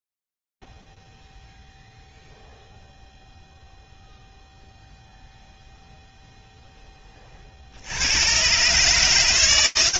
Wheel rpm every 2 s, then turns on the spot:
0, 0, 0, 10, 130.
none